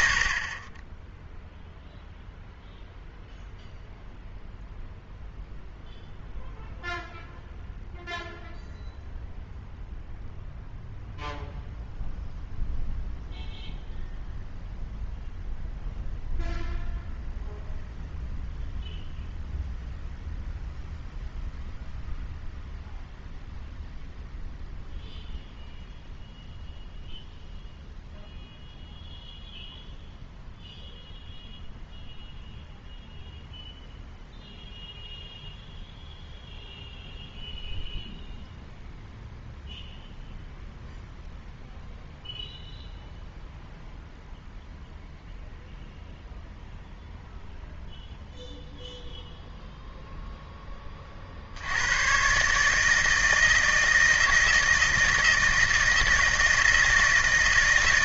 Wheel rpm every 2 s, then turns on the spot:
30, 0, 0, 0, 0, 0, 0, 0, 0, 0, 0, 0, 0, 0, 0, 0, 0, 0, 0, 0, 0, 0, 0, 0, 0, 10, 150, 160, 160.
none